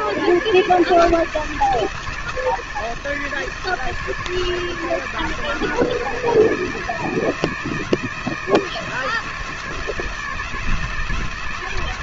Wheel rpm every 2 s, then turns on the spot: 160, 160, 160, 170, 160, 160.
none